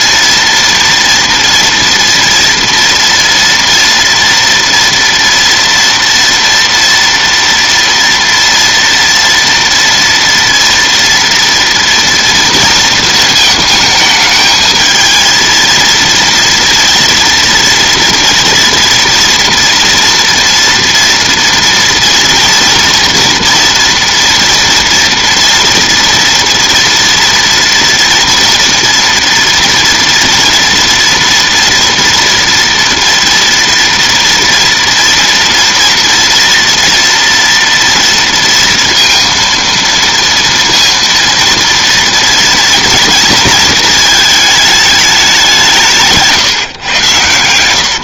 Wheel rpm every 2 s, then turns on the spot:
240, 230, 230, 230, 240, 230, 230, 220, 230, 230, 230, 230, 230, 230, 230, 230, 230, 230, 230, 230, 230, 230, 220, 140.
none